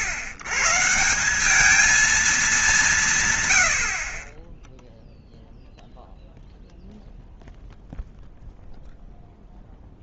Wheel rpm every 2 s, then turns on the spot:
120, 190, 0, 0, 0.
none